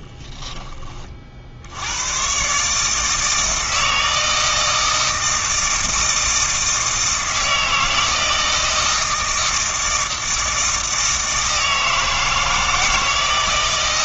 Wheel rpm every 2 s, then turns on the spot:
20, 150, 160, 160, 160, 160, 160.
none